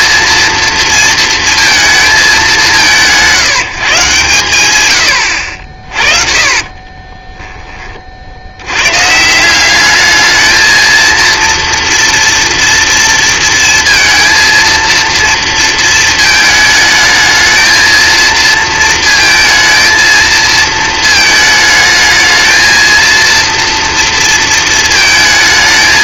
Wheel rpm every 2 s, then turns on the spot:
230, 170, 130, 30, 100, 220, 230, 230, 220, 230, 220, 230, 230.
6-8